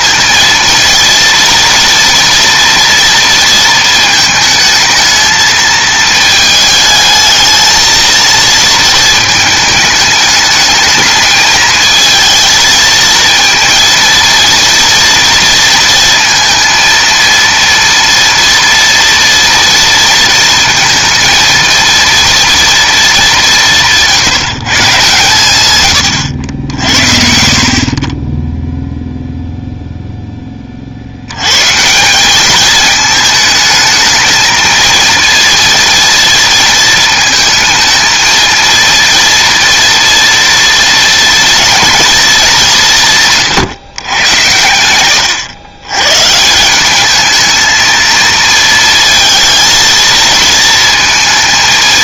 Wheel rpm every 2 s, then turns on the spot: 230, 230, 220, 220, 230, 220, 230, 230, 230, 230, 230, 230, 150, 90, 10, 30, 210, 230, 230, 230, 230, 190, 100, 180, 230, 230.
none